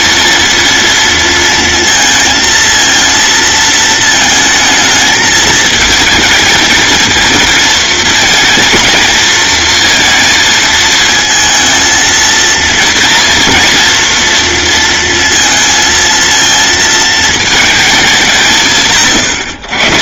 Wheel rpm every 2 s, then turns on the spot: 230, 230, 220, 230, 230, 230, 230, 230, 220, 130.
none